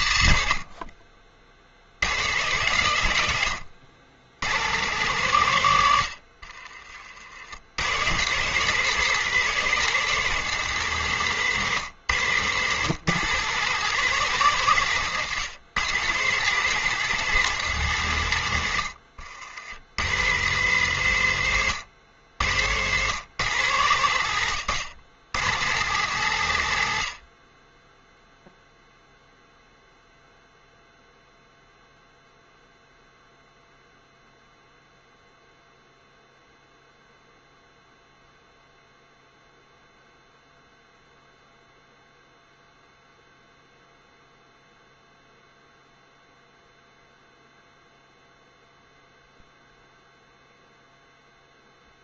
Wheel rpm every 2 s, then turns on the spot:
80, 140, 120, 50, 170, 170, 140, 140, 170, 100, 150, 120, 120, 100, 0, 0, 0, 0, 0, 0, 0, 0, 0, 0, 0, 0.
6-8